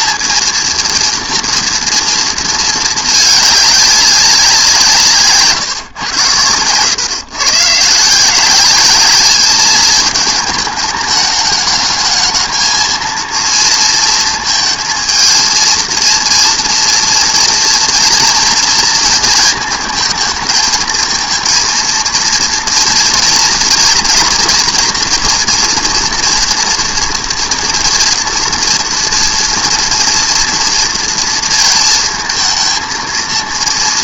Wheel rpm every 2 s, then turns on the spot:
230, 220, 180, 110, 190, 220, 220, 230, 230, 230, 220, 230, 240, 230, 230, 230, 220.
none